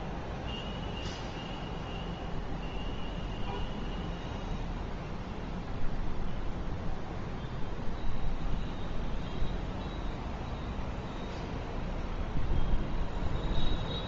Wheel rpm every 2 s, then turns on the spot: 0, 0, 0, 0, 0, 0, 0.
none